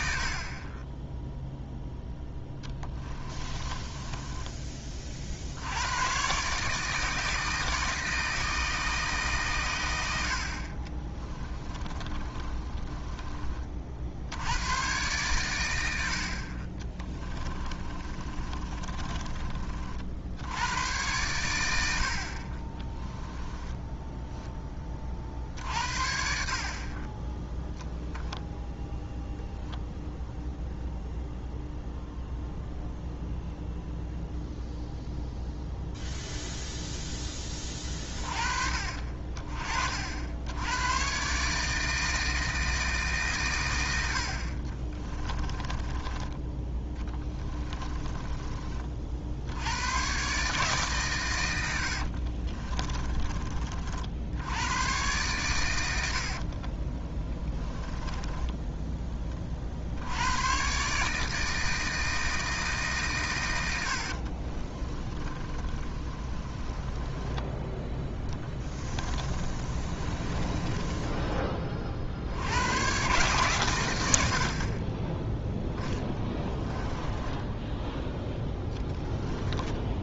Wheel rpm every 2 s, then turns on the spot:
20, 10, 30, 150, 160, 50, 20, 120, 30, 30, 100, 20, 30, 40, 0, 0, 0, 0, 0, 40, 110, 160, 40, 20, 40, 140, 30, 110, 40, 10, 140, 150, 40, 20, 30, 20, 110, 40, 10, 10.
0-4 10-14 16-20 22-24 44-46 52-54 56-58 64-72 76-80